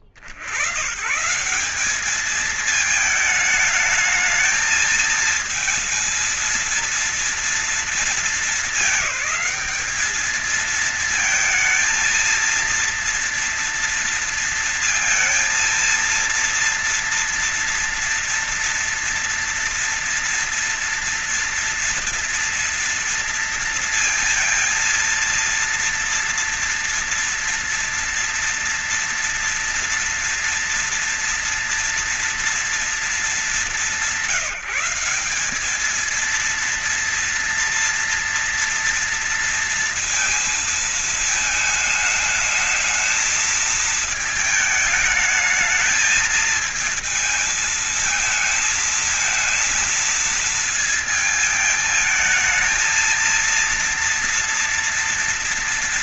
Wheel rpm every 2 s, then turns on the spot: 30, 200, 220, 230, 220, 210, 230, 230, 230, 230, 230, 230, 230, 230, 230, 230, 230, 180, 210, 230, 230, 220, 220, 220, 220, 230, 220, 230.
none